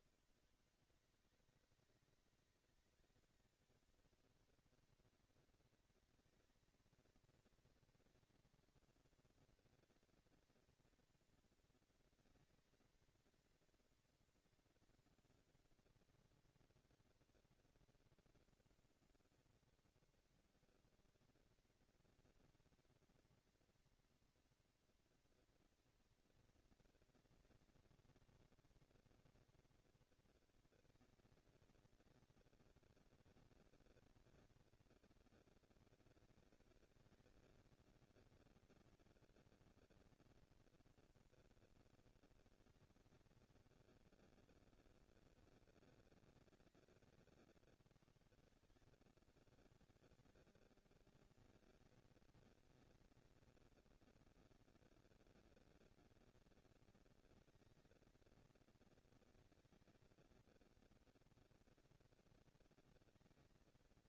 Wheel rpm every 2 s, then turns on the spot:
200, 190, 220, 230, 230, 230, 230, 230, 230, 230, 230, 230, 230, 230, 230, 230, 220, 220, 220, 230, 230, 230, 200, 180, 100, 190, 220, 230, 230, 230, 230, 230.
none